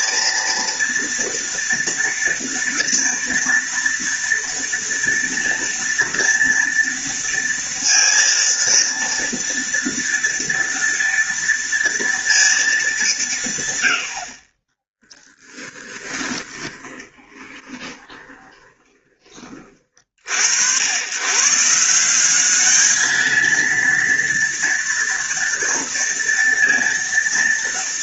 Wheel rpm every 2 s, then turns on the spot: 230, 240, 230, 230, 230, 230, 230, 40, 20, 20, 70, 200, 230, 230.
16-20